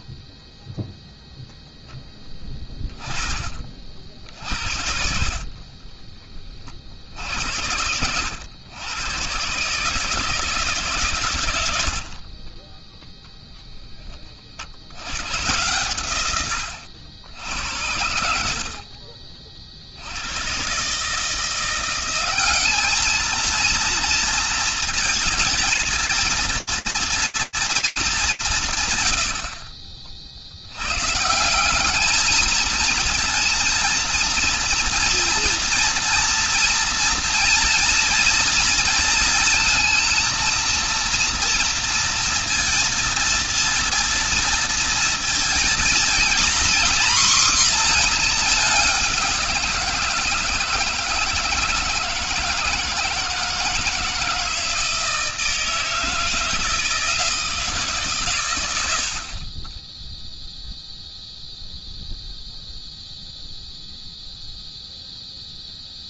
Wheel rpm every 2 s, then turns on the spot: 20, 10, 60, 40, 110, 140, 30, 50, 110, 70, 110, 200, 230, 230, 190, 80, 220, 230, 230, 230, 230, 230, 230, 240, 210, 160, 160, 160, 160, 70, 0, 0, 0.
none